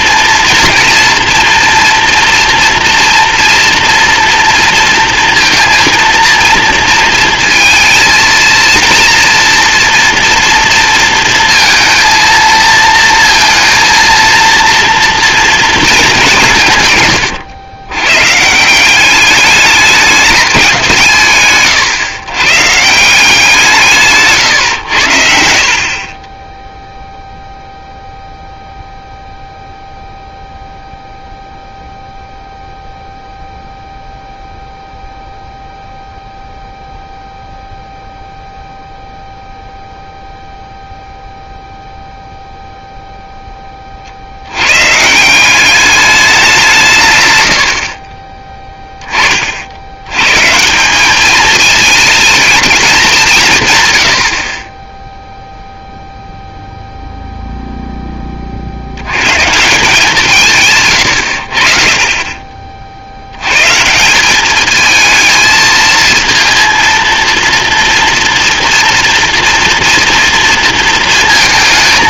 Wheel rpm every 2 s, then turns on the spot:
230, 230, 230, 230, 230, 230, 230, 230, 150, 170, 190, 140, 110, 0, 0, 0, 0, 0, 0, 0, 0, 0, 110, 170, 10, 160, 210, 20, 0, 50, 140, 50, 220, 230, 230, 230.
none